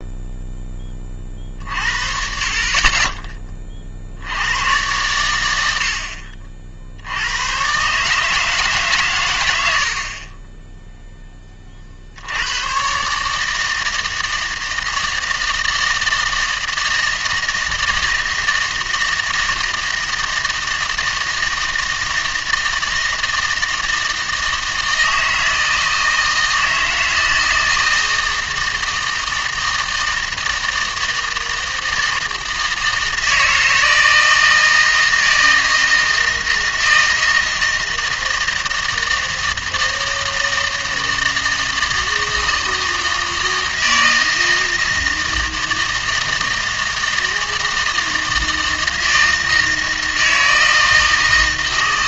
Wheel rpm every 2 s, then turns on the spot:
10, 40, 100, 60, 150, 10, 100, 160, 160, 160, 160, 160, 160, 160, 160, 160, 160, 160, 160, 160, 160, 160, 160, 160, 160, 160.
none